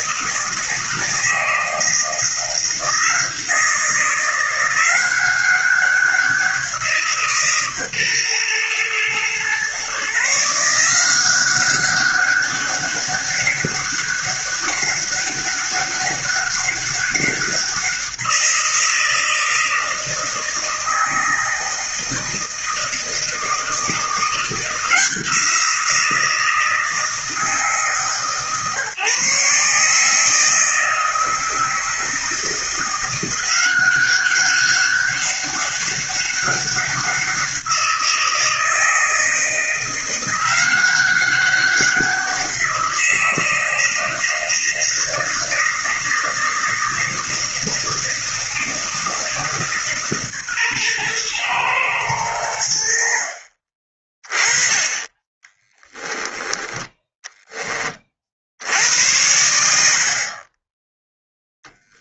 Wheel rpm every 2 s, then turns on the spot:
160, 170, 180, 170, 120, 160, 200, 200, 200, 170, 160, 160, 170, 160, 140, 160, 170, 200, 200, 160, 180, 180, 160, 160, 160, 130, 90, 20, 10, 60, 20.
none